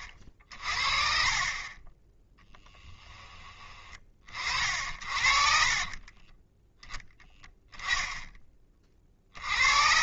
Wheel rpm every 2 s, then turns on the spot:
20, 10, 50, 10, 30.
none